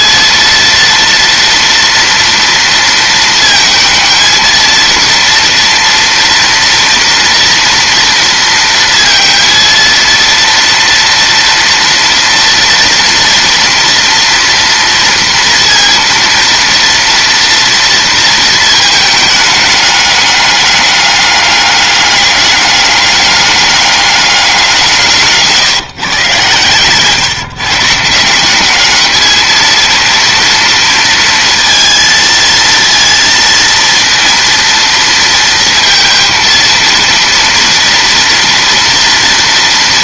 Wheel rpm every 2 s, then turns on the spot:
230, 230, 230, 230, 230, 230, 230, 240, 230, 220, 210, 200, 180, 120, 190, 230, 230, 230, 230, 230.
26-28